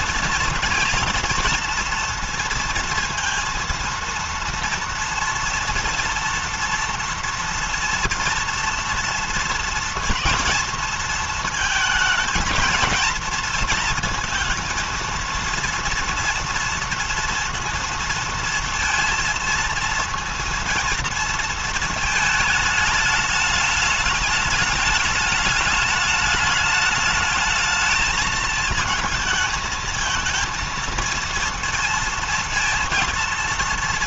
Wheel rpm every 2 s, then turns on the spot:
230, 230, 230, 230, 230, 230, 220, 230, 230, 230, 230, 210, 210, 220, 220, 230, 230.
none